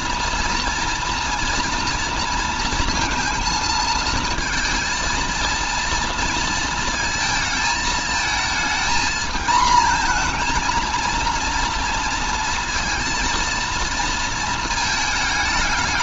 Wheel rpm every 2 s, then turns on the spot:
240, 230, 230, 220, 220, 230, 230, 220.
none